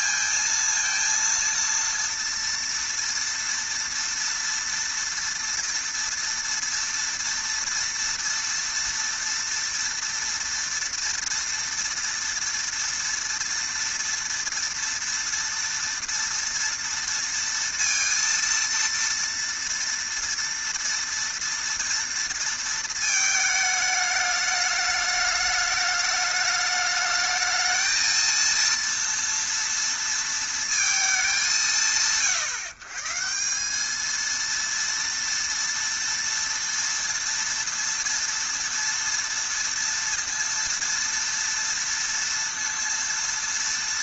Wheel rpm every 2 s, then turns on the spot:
230, 230, 230, 230, 230, 230, 230, 230, 230, 230, 240, 230, 210, 210, 230, 230, 130, 230, 230, 230, 230, 230.
none